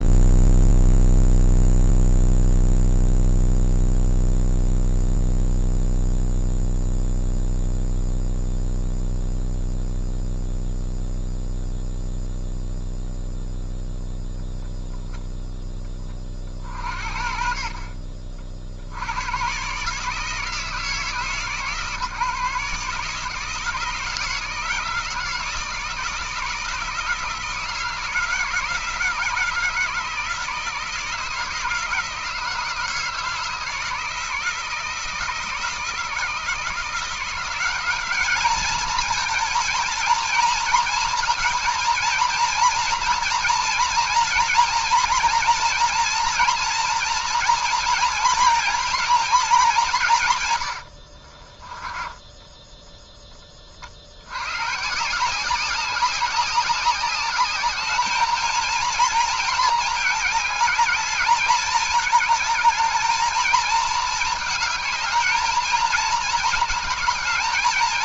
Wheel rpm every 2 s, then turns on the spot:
0, 0, 0, 0, 0, 0, 0, 0, 40, 50, 160, 150, 170, 160, 160, 160, 160, 160, 170, 210, 230, 230, 230, 230, 230, 110, 10, 110, 190, 220, 210, 220, 220, 220.
50-54